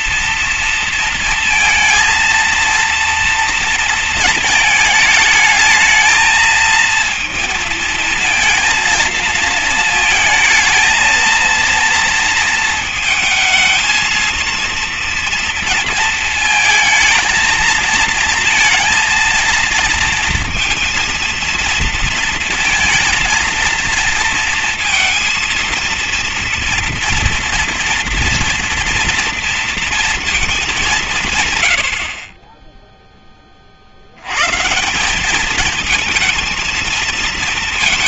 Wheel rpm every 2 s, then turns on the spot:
230, 230, 220, 220, 230, 220, 230, 230, 230, 230, 230, 230, 230, 230, 240, 210, 20, 140, 220.
none